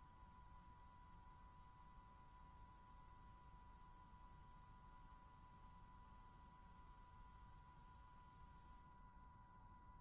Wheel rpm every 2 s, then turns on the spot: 120, 120, 120, 120, 120.
none